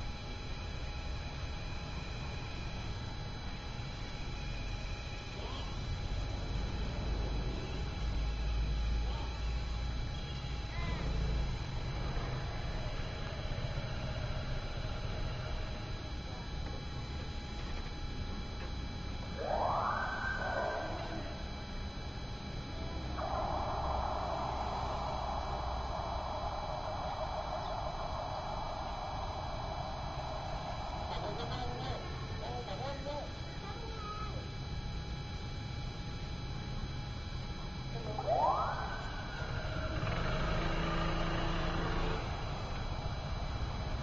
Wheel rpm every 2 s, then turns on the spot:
0, 0, 0, 0, 0, 0, 0, 0, 0, 0, 0, 0, 0, 0, 0, 0, 0, 0, 0, 0, 0, 0.
none